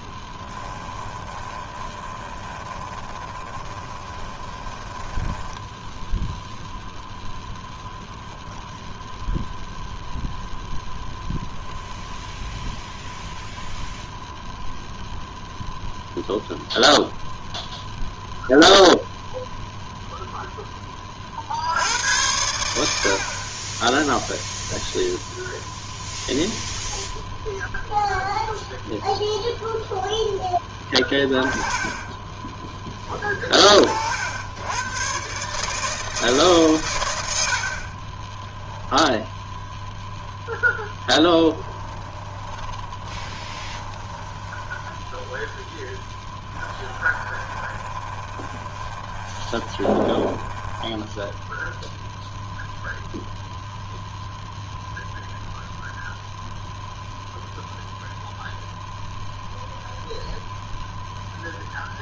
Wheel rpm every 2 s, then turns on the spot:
20, 20, 10, 0, 0, 0, 0, 0, 0, 0, 10, 60, 0, 10, 20, 20, 10, 100, 140, 10, 0, 20, 10, 10, 30, 10, 0, 0, 0, 0, 0.
0-6 30-32 38-40 42-52